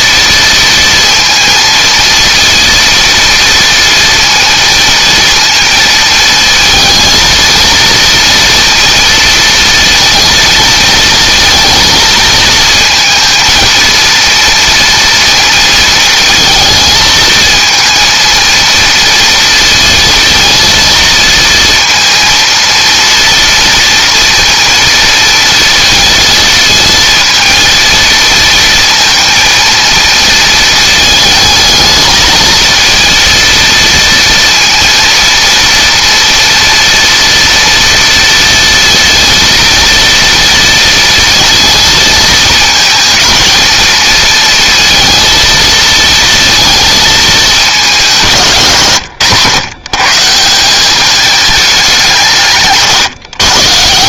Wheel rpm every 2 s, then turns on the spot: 230, 230, 230, 220, 230, 230, 230, 230, 220, 230, 230, 230, 230, 230, 230, 220, 220, 230, 230, 230, 230, 230, 230, 220, 130, 200, 140.
none